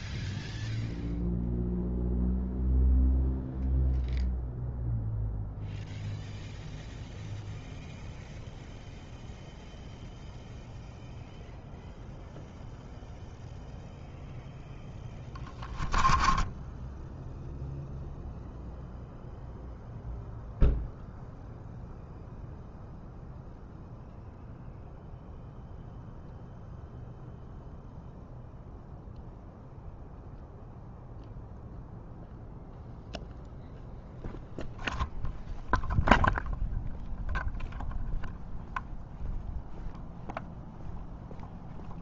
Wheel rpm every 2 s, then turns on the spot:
0, 0, 0, 0, 0, 0, 0, 0, 10, 0, 0, 0, 0, 0, 0, 0, 0, 0, 0, 0, 0.
16-18